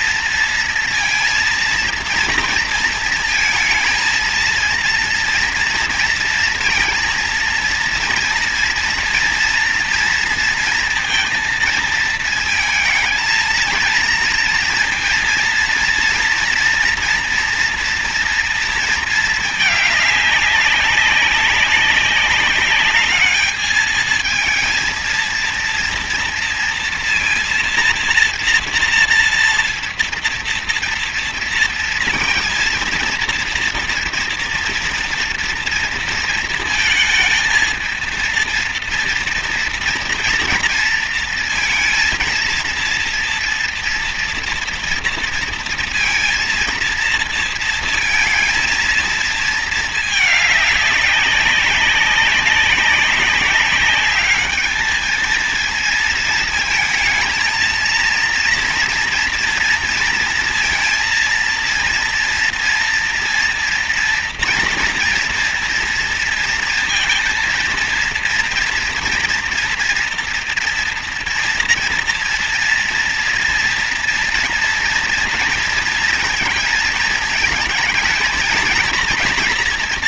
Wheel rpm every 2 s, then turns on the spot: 230, 230, 230, 230, 230, 230, 220, 230, 240, 230, 200, 200, 220, 230, 230, 230, 230, 230, 230, 230, 230, 230, 230, 230, 230, 210, 200, 210, 220, 230, 230, 230, 240, 230, 230, 230, 240, 240, 230, 230.
none